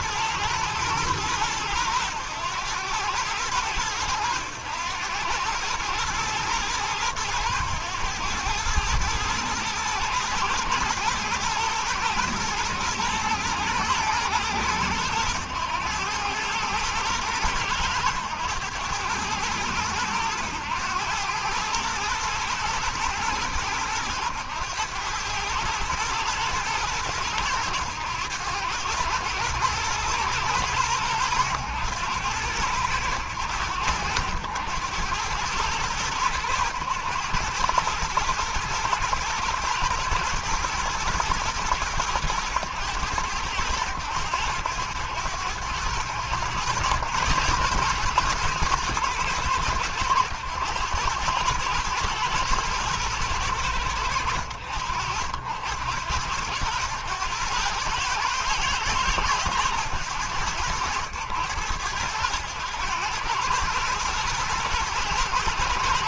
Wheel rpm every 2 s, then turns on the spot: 110, 100, 100, 110, 110, 120, 110, 110, 110, 110, 100, 110, 110, 100, 110, 100, 100, 100, 100, 120, 110, 100, 90, 110, 110, 100, 110, 80, 100, 100, 90, 100, 110.
none